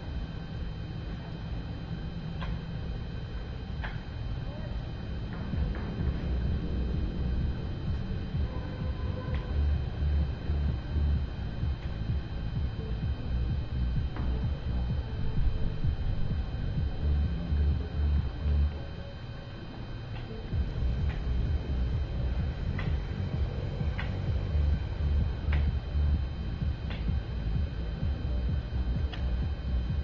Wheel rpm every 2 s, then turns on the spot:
0, 0, 0, 0, 0, 0, 0, 0, 0, 0, 0, 0, 0, 0, 0.
none